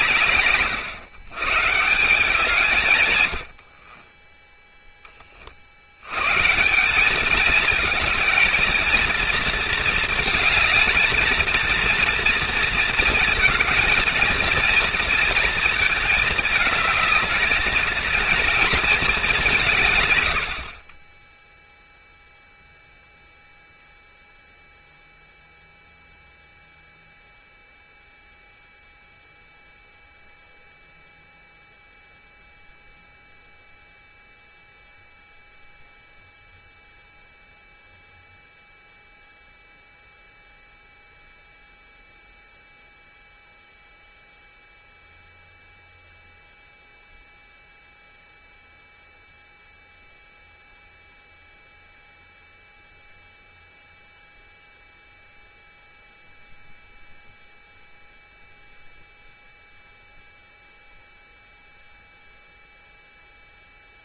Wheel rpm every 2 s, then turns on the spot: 120, 90, 40, 220, 230, 220, 230, 230, 220, 170, 0, 0, 0, 0, 0, 0, 0, 0, 0, 0, 0, 0, 0, 0, 0, 0, 0, 0, 0, 0, 0, 0.
none